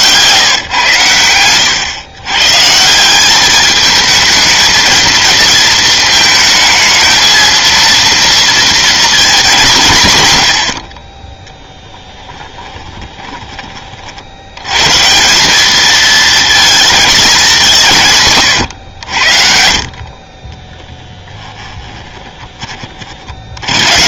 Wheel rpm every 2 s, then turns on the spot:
160, 130, 220, 220, 230, 90, 10, 80, 230, 130, 30, 20.
12-14